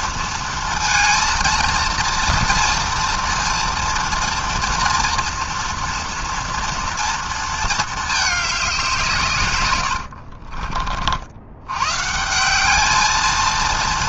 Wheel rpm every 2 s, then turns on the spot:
220, 230, 230, 230, 190, 50, 180.
10-12